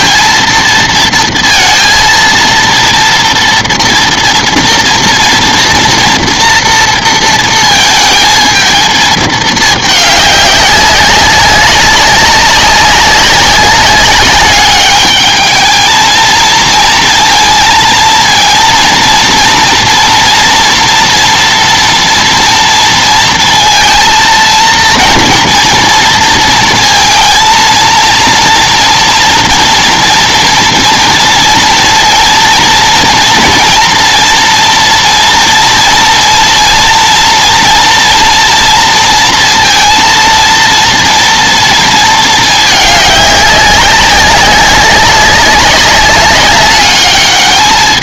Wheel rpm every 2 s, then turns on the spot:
230, 230, 230, 240, 220, 200, 190, 210, 230, 230, 240, 230, 230, 230, 230, 230, 230, 230, 230, 230, 230, 220, 200, 200.
none